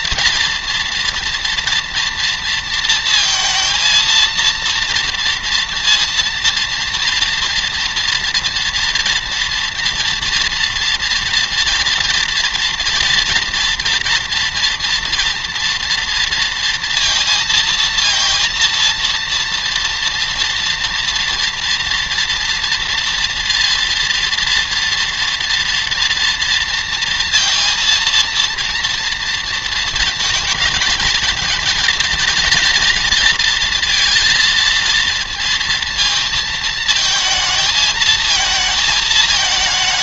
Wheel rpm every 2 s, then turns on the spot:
240, 230, 230, 230, 230, 230, 230, 230, 230, 230, 230, 230, 230, 230, 230, 220, 230, 230, 230, 220.
none